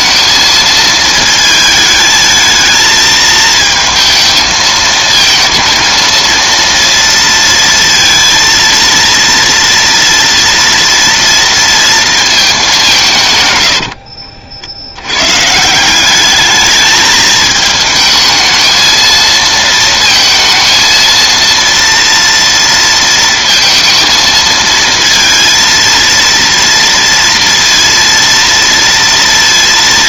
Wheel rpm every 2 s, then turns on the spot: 230, 220, 220, 230, 230, 230, 190, 70, 220, 220, 230, 230, 230, 230, 230.
none